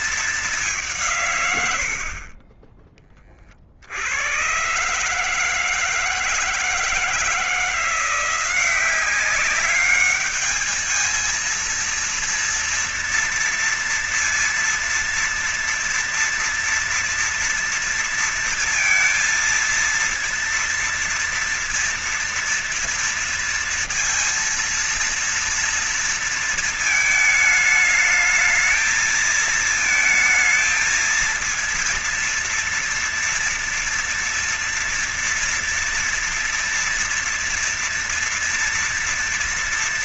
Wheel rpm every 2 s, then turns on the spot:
210, 50, 100, 160, 180, 210, 230, 230, 240, 230, 230, 230, 230, 230, 220, 220, 230, 230, 230, 230.
none